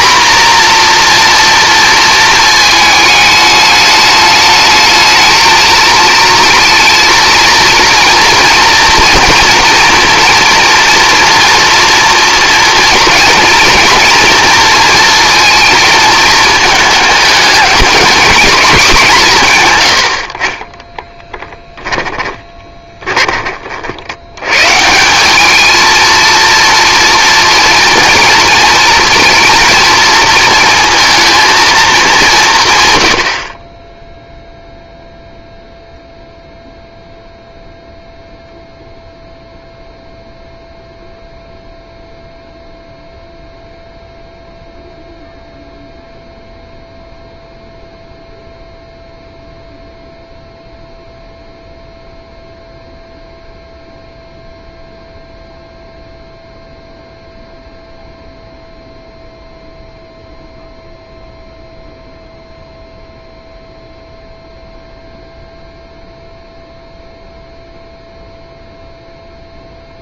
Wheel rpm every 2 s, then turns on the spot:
240, 220, 220, 230, 230, 230, 230, 230, 210, 200, 20, 20, 160, 230, 230, 230, 140, 0, 0, 0, 0, 0, 0, 0, 0, 0, 0, 0, 0, 0, 0, 0, 0, 0, 0.
20-24